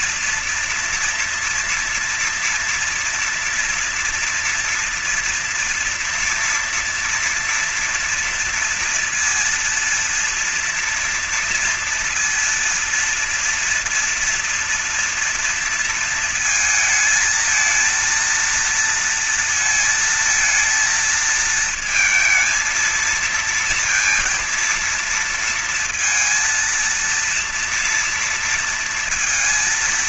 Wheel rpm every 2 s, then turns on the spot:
230, 240, 230, 230, 230, 230, 230, 230, 220, 230, 230, 230, 230, 220, 230.
none